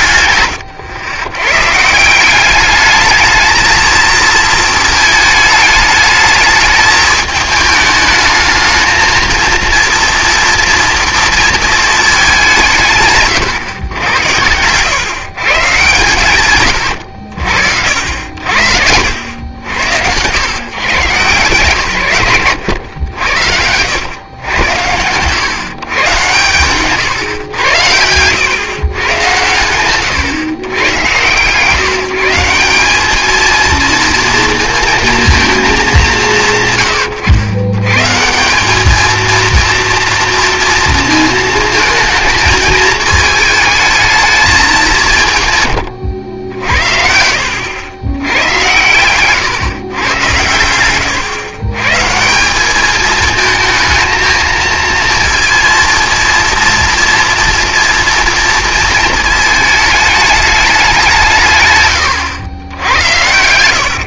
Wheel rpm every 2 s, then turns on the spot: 110, 200, 220, 220, 220, 230, 170, 110, 110, 70, 130, 100, 100, 130, 120, 120, 190, 230, 130, 200, 230, 220, 210, 70, 100, 110, 200, 230, 230, 230, 200, 90.
18-20 26-28